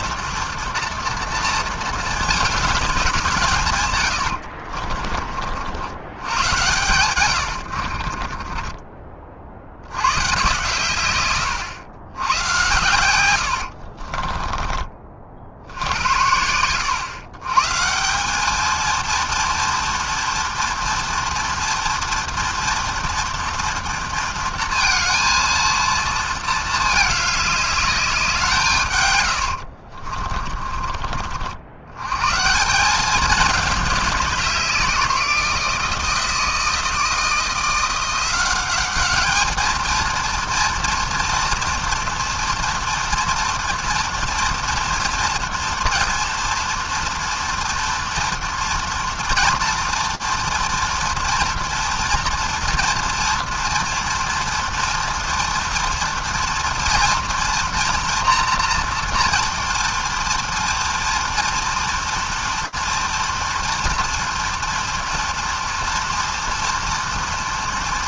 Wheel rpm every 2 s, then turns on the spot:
230, 210, 50, 110, 30, 130, 100, 30, 100, 200, 230, 240, 230, 220, 160, 30, 150, 190, 160, 190, 230, 230, 230, 240, 240, 230, 230, 230, 230, 230, 230, 230, 230, 240.
4-6 8-10 14-16 30-32